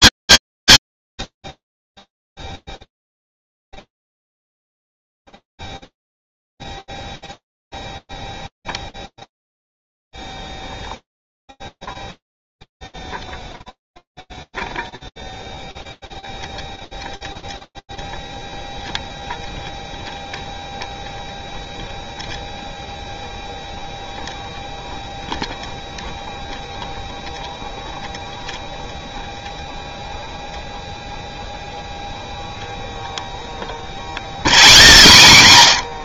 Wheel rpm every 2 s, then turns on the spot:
0, 0, 0, 0, 0, 0, 0, 0, 0, 0, 0, 0, 0, 0, 0, 0, 0, 0.
none